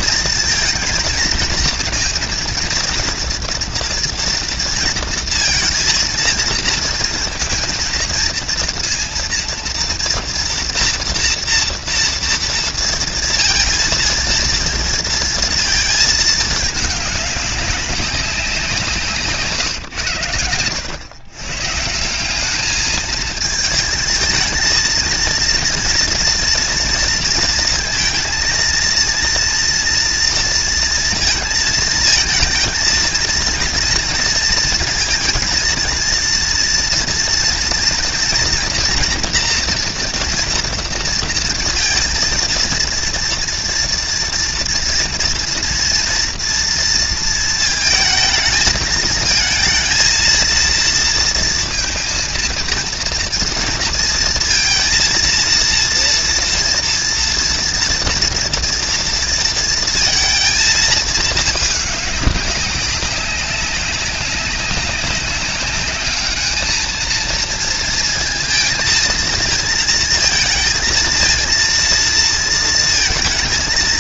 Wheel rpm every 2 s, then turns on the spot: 230, 230, 230, 230, 230, 230, 230, 230, 210, 170, 100, 210, 230, 230, 230, 230, 230, 220, 230, 240, 230, 230, 230, 230, 220, 230, 230, 230, 230, 240, 220, 200, 200, 220, 230, 230, 230.
none